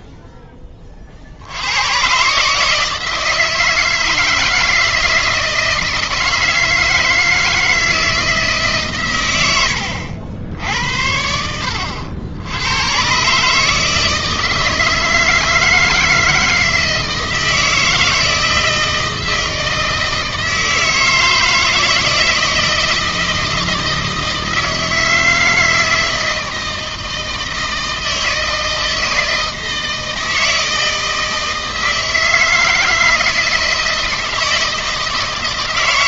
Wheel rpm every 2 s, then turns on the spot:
20, 150, 160, 160, 150, 70, 100, 160, 160, 160, 160, 160, 160, 160, 160, 160, 160, 160.
none